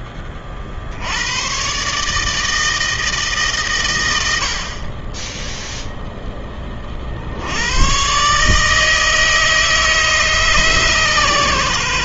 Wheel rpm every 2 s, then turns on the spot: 40, 160, 70, 30, 160, 140.
none